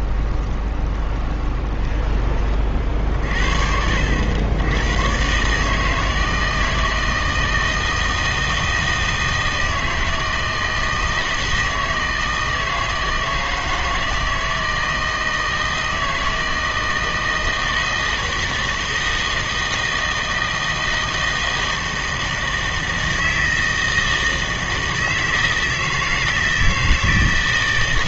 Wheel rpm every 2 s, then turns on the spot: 20, 40, 100, 160, 160, 160, 160, 160, 160, 160, 160, 160, 170, 160.
0-2